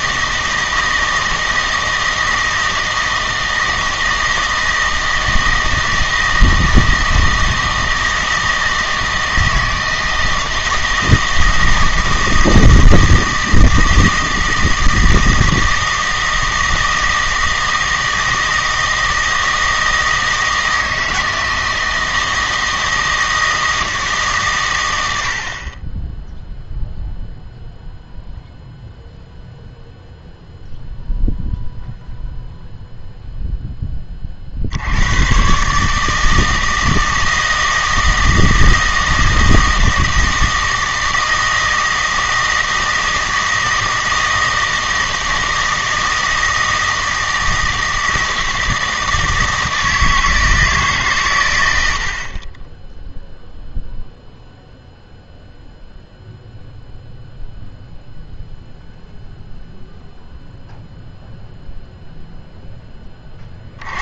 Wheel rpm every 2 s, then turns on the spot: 160, 160, 160, 160, 160, 160, 160, 160, 160, 160, 160, 160, 120, 0, 0, 0, 0, 60, 160, 160, 160, 160, 160, 160, 160, 150, 10, 0, 0, 0, 0, 10.
none